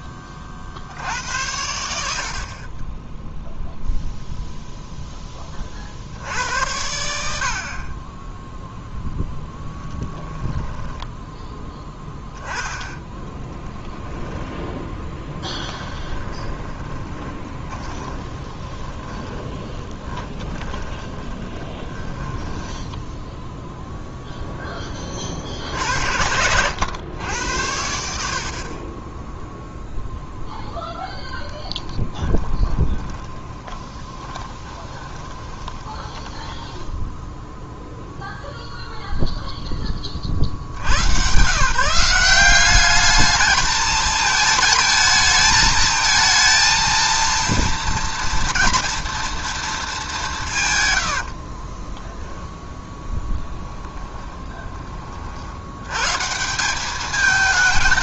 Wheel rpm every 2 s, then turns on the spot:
60, 10, 0, 80, 0, 10, 10, 10, 20, 10, 20, 10, 20, 100, 20, 10, 20, 20, 10, 0, 120, 210, 220, 230, 230, 100, 10, 30, 210.
10-12 14-24 32-38